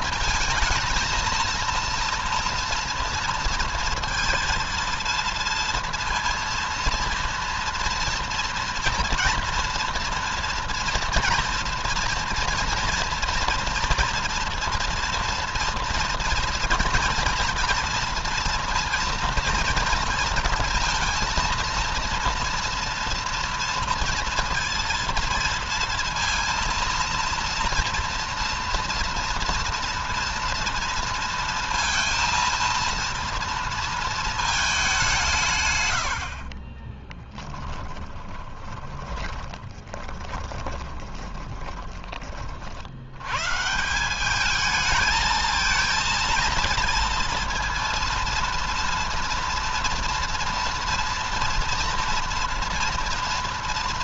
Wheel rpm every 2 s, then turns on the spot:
230, 230, 230, 230, 230, 230, 240, 230, 230, 230, 230, 230, 230, 230, 240, 230, 230, 200, 30, 20, 20, 70, 220, 230, 230, 230, 230.
36-42